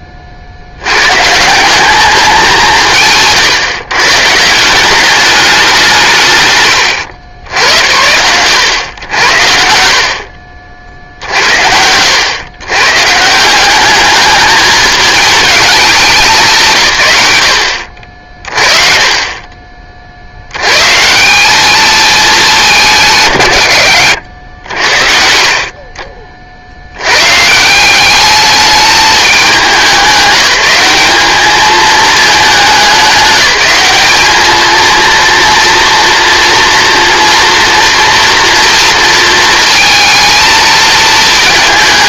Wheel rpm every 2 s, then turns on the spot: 80, 160, 190, 120, 100, 50, 130, 210, 130, 40, 120, 190, 80, 70, 210, 210, 210, 220, 240, 230, 220.
none